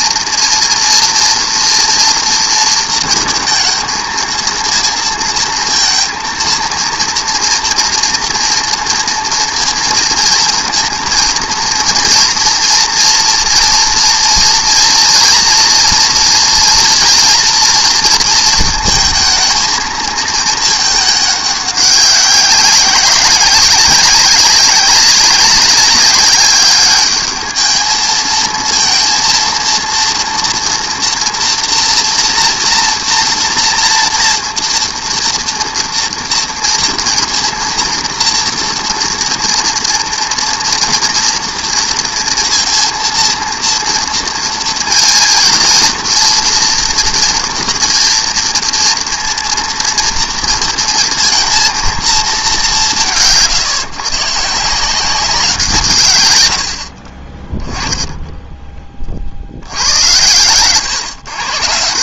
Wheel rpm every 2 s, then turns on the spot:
240, 230, 220, 230, 230, 230, 230, 230, 240, 230, 220, 190, 190, 200, 220, 240, 240, 230, 230, 230, 230, 230, 230, 230, 230, 230, 200, 150, 90, 10, 110.
none